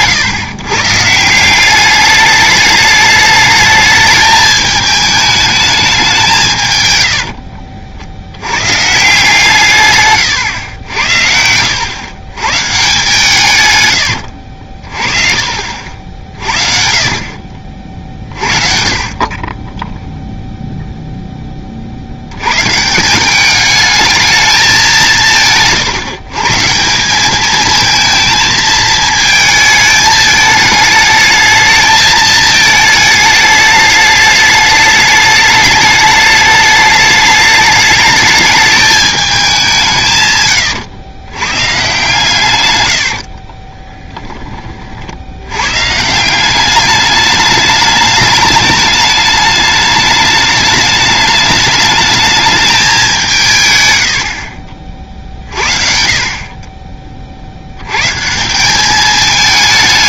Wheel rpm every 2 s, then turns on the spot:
130, 210, 220, 120, 130, 90, 140, 50, 40, 40, 0, 130, 190, 170, 220, 210, 220, 210, 210, 210, 110, 90, 40, 200, 210, 210, 210, 50, 30, 200.
42-44